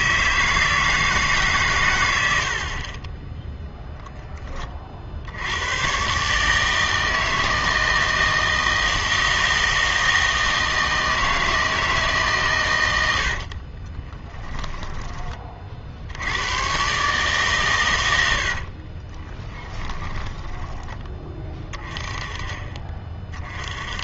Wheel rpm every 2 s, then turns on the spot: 160, 60, 30, 150, 160, 160, 100, 10, 100, 60, 20, 30.
14-16 18-22